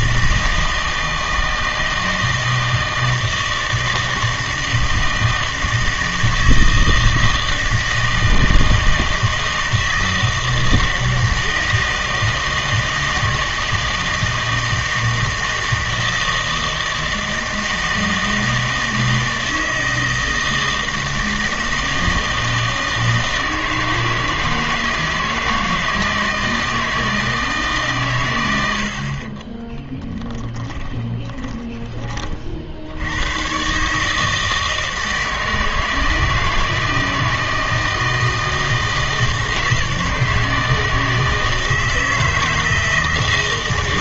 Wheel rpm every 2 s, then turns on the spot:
160, 160, 160, 160, 160, 160, 160, 160, 160, 160, 160, 160, 160, 160, 90, 20, 60, 160, 160, 160, 160, 160.
30-32